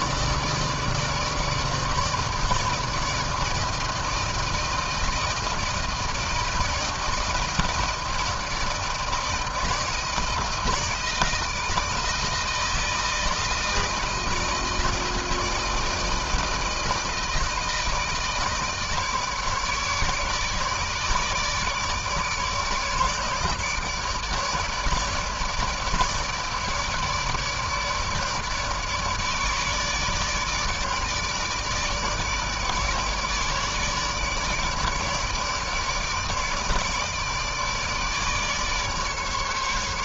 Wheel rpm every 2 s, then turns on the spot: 160, 160, 160, 160, 160, 160, 160, 160, 160, 160, 150, 150, 150, 150, 150, 150, 150, 150, 150, 150.
none